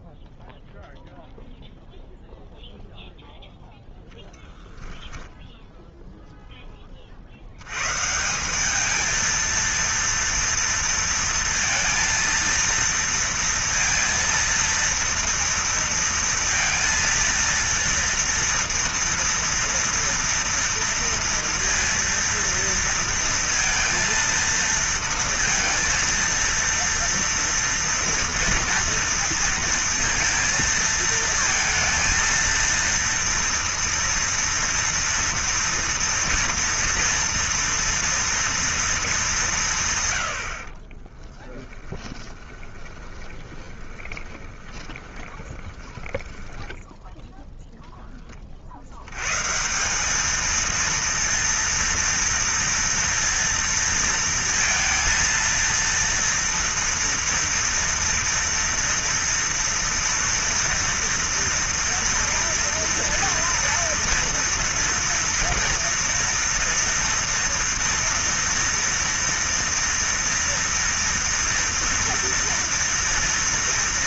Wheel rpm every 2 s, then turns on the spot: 0, 10, 0, 130, 230, 230, 230, 230, 230, 230, 230, 230, 230, 230, 230, 230, 230, 230, 230, 100, 20, 20, 10, 30, 220, 230, 230, 230, 230, 230, 230, 230, 230, 230, 230, 230, 230.
40-46